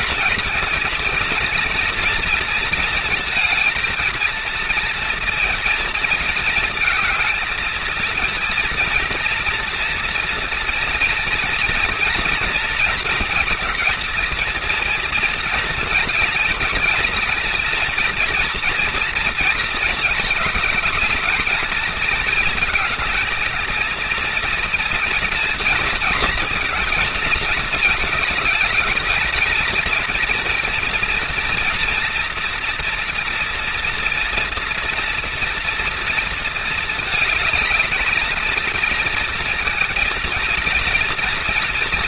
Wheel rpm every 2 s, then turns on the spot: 230, 230, 230, 230, 230, 230, 230, 230, 220, 230, 210, 220, 230, 230, 230, 240, 240, 230, 220, 230, 230.
none